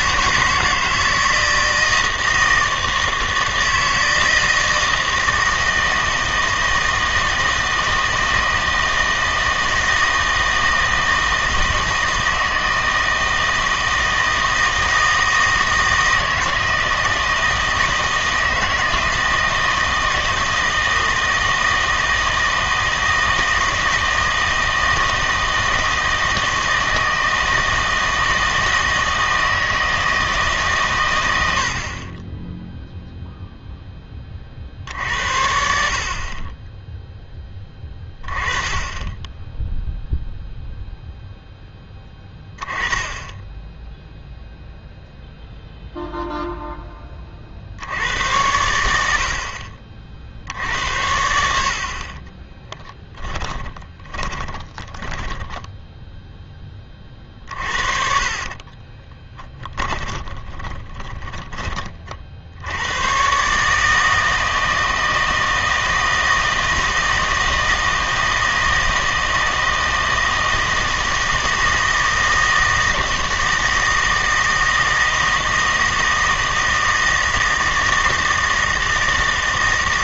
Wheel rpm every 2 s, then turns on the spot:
160, 160, 160, 160, 160, 160, 160, 160, 160, 160, 160, 160, 160, 160, 160, 150, 10, 50, 20, 20, 0, 10, 0, 0, 100, 60, 10, 20, 20, 30, 30, 80, 160, 160, 160, 160, 160, 160, 160, 160.
52-56 58-62